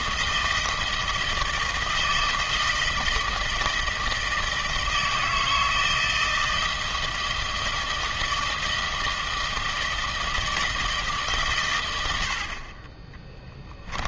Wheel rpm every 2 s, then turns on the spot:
160, 160, 160, 160, 160, 160, 30.
none